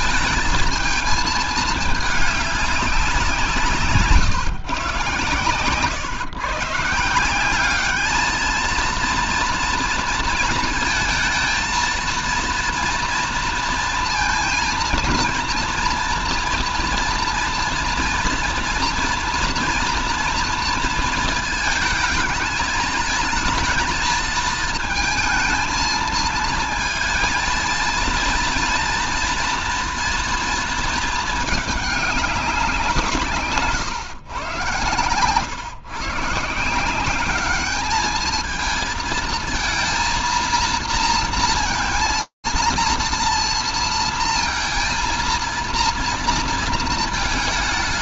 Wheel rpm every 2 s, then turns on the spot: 220, 200, 130, 150, 220, 230, 230, 230, 230, 230, 230, 220, 220, 230, 230, 230, 180, 130, 180, 220, 230, 230, 230, 220.
none